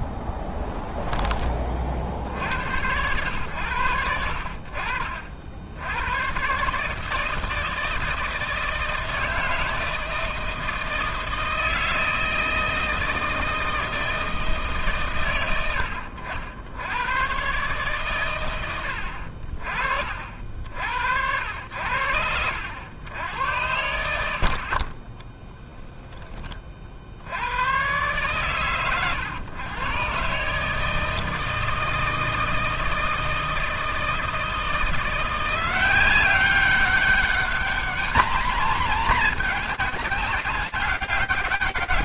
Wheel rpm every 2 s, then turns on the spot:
10, 90, 60, 140, 160, 160, 160, 140, 90, 90, 70, 90, 40, 40, 120, 150, 160, 170, 200, 240, 190.
0-2